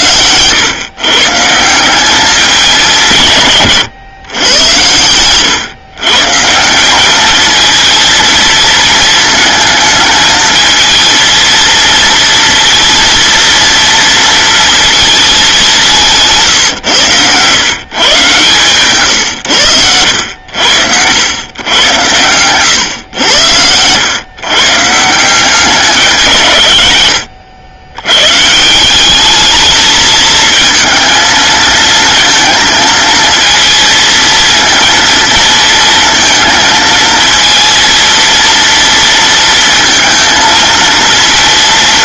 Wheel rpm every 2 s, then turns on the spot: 120, 200, 100, 170, 220, 220, 230, 230, 130, 130, 80, 110, 130, 140, 160, 220, 220, 230, 230, 230, 230.
16-18